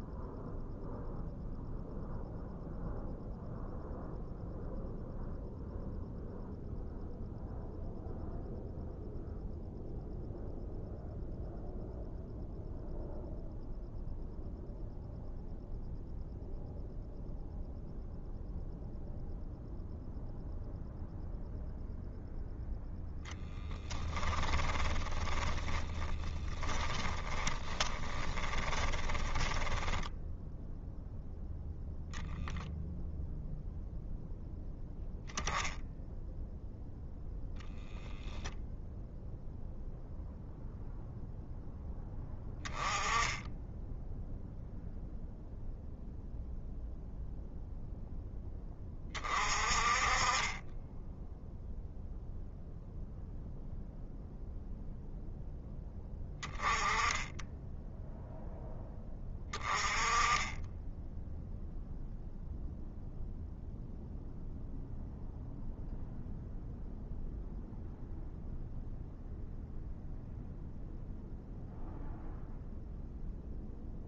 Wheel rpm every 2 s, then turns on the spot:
0, 0, 0, 0, 0, 0, 0, 0, 0, 0, 0, 0, 10, 20, 20, 0, 0, 0, 0, 0, 0, 10, 0, 0, 0, 30, 0, 0, 10, 0, 10, 0, 0, 0, 0, 0, 0.
24-30